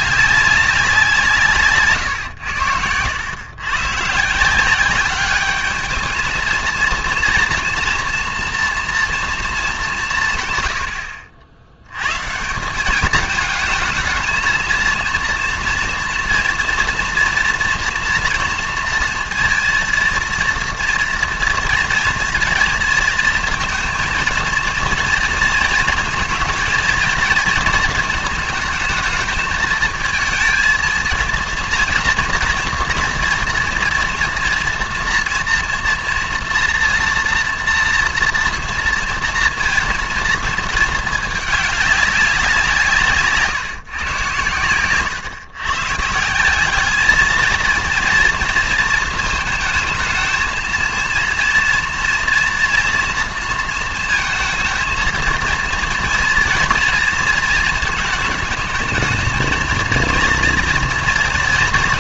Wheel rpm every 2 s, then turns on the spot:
190, 90, 180, 230, 230, 110, 180, 230, 230, 230, 230, 230, 230, 230, 220, 230, 230, 230, 230, 230, 220, 170, 110, 200, 220, 220, 230, 220, 230, 220, 230.
2-4